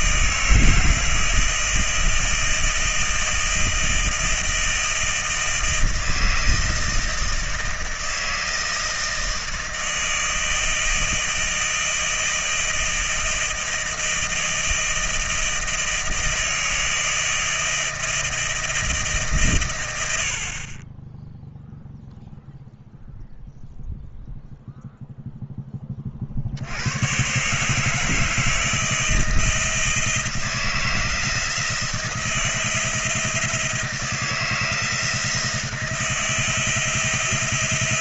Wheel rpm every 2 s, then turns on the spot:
160, 160, 160, 160, 160, 160, 160, 160, 160, 160, 80, 0, 0, 30, 160, 170, 170, 160, 160.
none